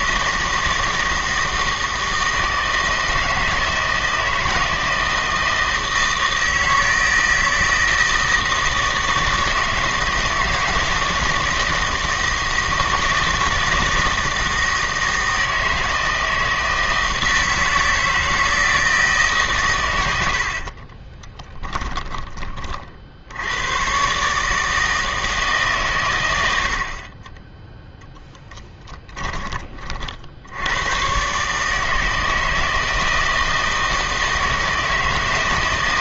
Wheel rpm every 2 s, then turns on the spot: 160, 160, 160, 160, 160, 160, 160, 160, 160, 160, 60, 40, 150, 80, 20, 90, 160, 160.
20-22 28-30